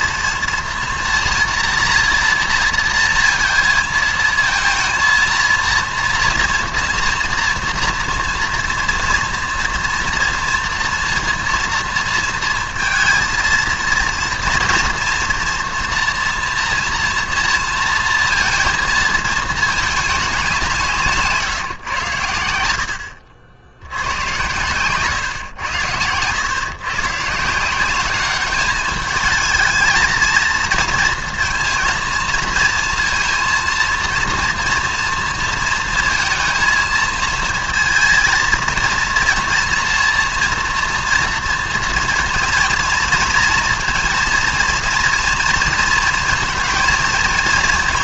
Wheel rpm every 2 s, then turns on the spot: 230, 230, 230, 230, 240, 230, 230, 230, 230, 230, 170, 80, 130, 120, 210, 230, 230, 230, 220, 230, 230, 230, 230, 230.
none